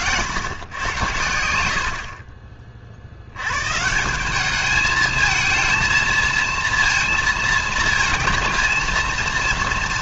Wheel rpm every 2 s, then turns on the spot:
110, 40, 210, 230, 230.
none